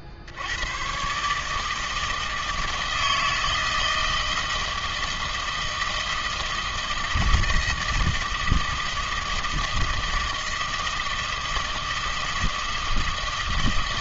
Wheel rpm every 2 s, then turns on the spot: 70, 160, 160, 160, 160, 160, 160.
none